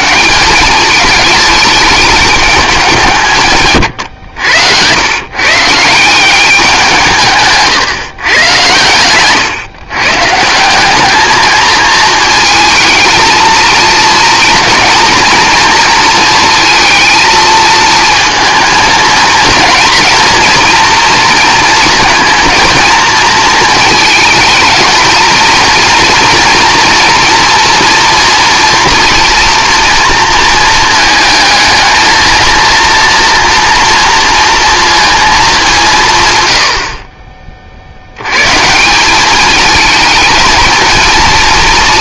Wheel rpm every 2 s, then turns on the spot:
200, 190, 100, 180, 120, 190, 220, 230, 220, 230, 230, 230, 230, 240, 230, 220, 230, 230, 90, 150, 220.
none